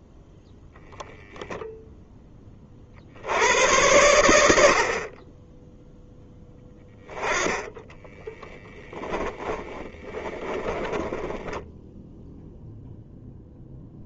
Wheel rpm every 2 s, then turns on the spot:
0, 30, 50, 10, 10, 10, 0.
8-12